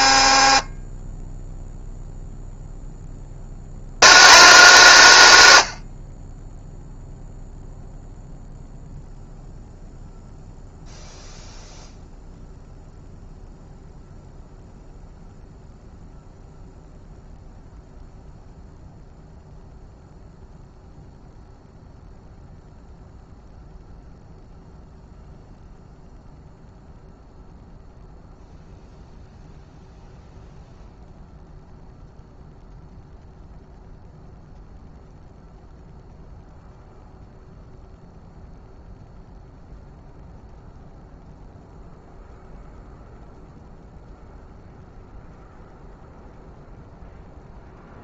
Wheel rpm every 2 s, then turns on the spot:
10, 50, 190, 0, 0, 0, 0, 0, 0, 0, 0, 0, 0, 0, 0, 0, 0, 0, 0, 0, 0, 0, 0, 0.
none